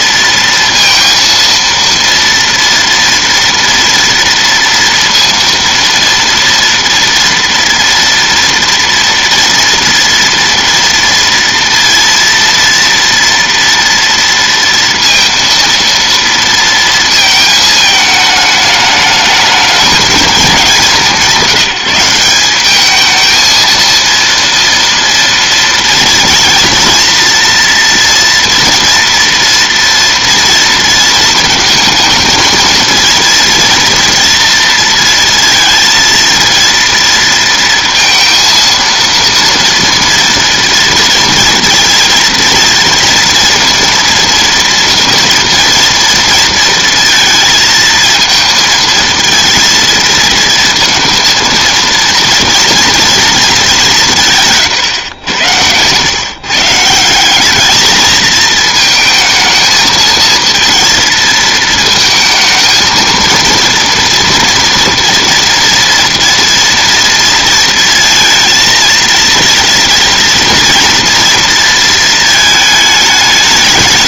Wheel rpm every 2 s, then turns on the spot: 230, 230, 230, 230, 230, 230, 230, 230, 230, 210, 200, 190, 230, 230, 230, 230, 220, 230, 230, 230, 230, 230, 230, 230, 220, 230, 230, 140, 150, 220, 230, 220, 230, 240, 230, 230, 220.
none